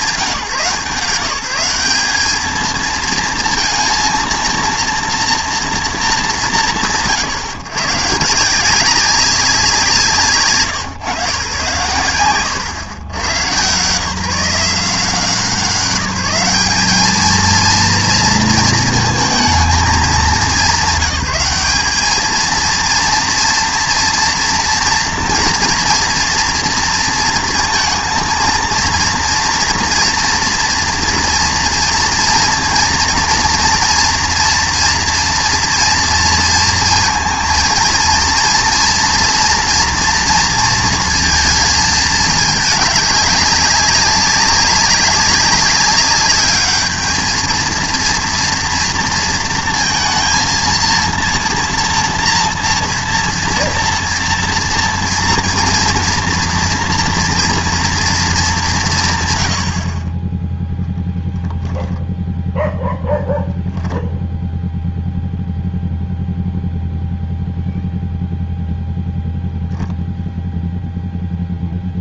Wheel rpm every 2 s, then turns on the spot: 160, 230, 230, 170, 180, 150, 120, 170, 210, 220, 200, 220, 230, 230, 230, 240, 230, 230, 230, 230, 230, 210, 200, 210, 230, 230, 230, 230, 230, 210, 10, 0, 0, 0, 0, 0.
none